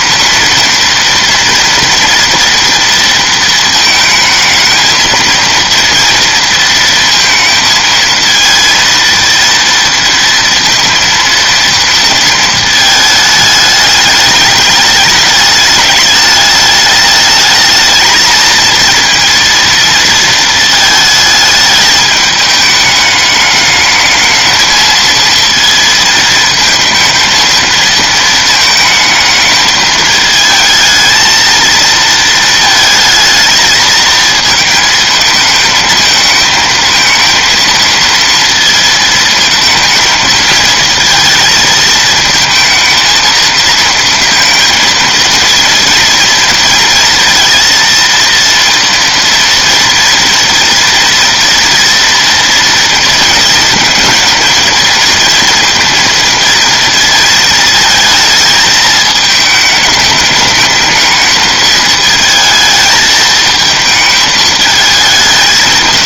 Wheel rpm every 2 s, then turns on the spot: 230, 230, 220, 230, 230, 230, 220, 210, 210, 230, 220, 210, 220, 220, 220, 220, 220, 220, 220, 230, 220, 220, 230, 230, 240, 230, 230, 230, 230, 220, 210, 220, 220.
none